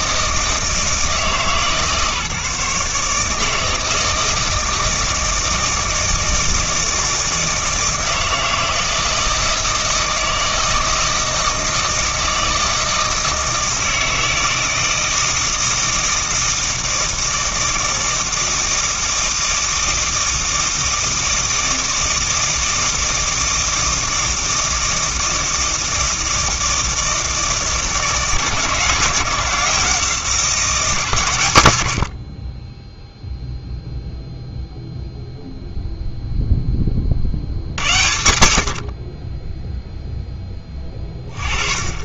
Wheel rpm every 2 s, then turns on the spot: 160, 150, 160, 160, 160, 160, 160, 160, 160, 160, 160, 160, 160, 160, 160, 140, 10, 0, 20, 60, 20.
none